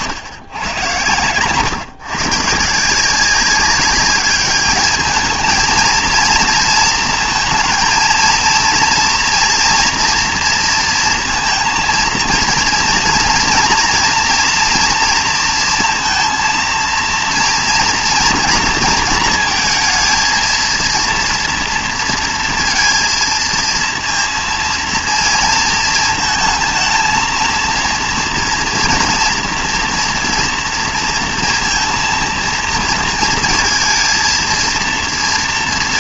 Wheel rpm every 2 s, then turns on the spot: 120, 150, 210, 230, 230, 230, 230, 240, 230, 230, 230, 230, 230, 220, 230, 230, 230, 220.
none